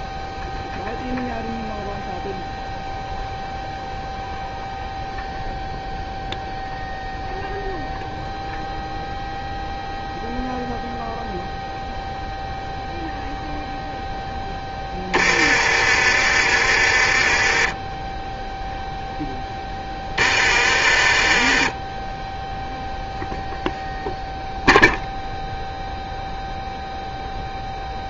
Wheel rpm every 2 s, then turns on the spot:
0, 0, 0, 0, 0, 0, 0, 20, 50, 0, 40, 0, 0, 0.
14-18 20-22